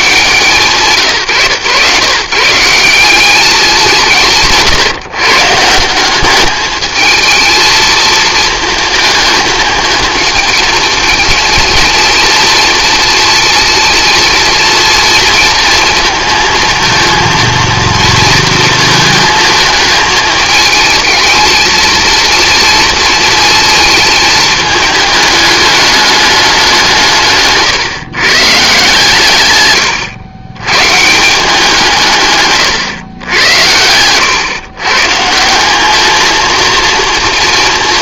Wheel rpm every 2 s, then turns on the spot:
150, 160, 140, 210, 220, 220, 230, 230, 230, 230, 220, 230, 210, 190, 150, 120, 130, 130, 230.
none